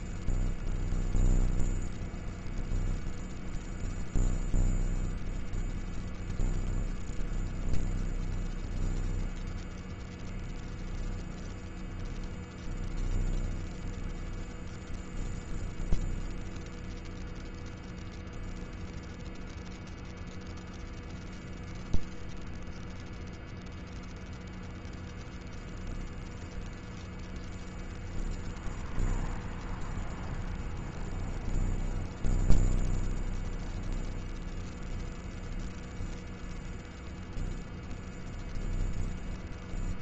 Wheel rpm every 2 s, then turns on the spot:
0, 0, 0, 0, 0, 0, 0, 0, 0, 0, 0, 0, 0, 0, 0, 0, 0, 0, 0, 0.
none